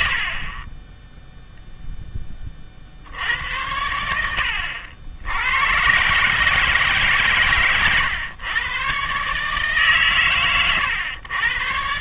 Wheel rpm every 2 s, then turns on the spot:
30, 30, 80, 150, 120, 120.
none